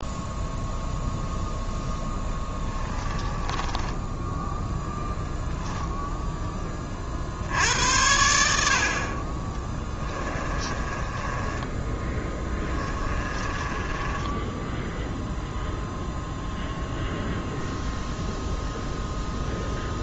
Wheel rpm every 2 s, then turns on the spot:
0, 20, 0, 30, 70, 20, 20, 0, 0, 0.
2-4 10-14